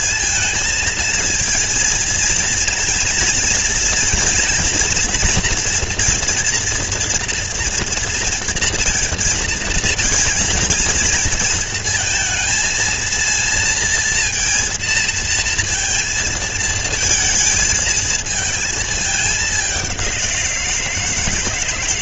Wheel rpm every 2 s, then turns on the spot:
220, 230, 230, 230, 230, 230, 230, 230, 230, 220, 190.
none